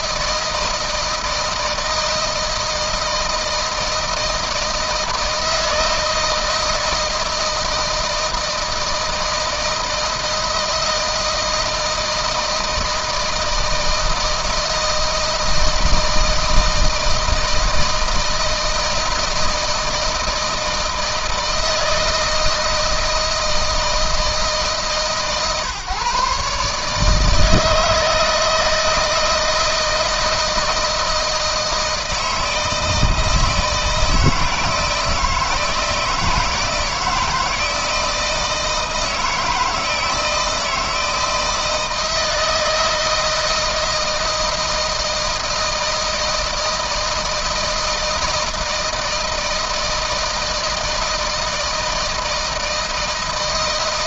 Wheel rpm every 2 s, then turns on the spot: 160, 160, 160, 160, 160, 160, 160, 160, 160, 160, 160, 160, 140, 150, 160, 160, 160, 160, 160, 160, 160, 160, 160, 160, 160, 160, 160.
none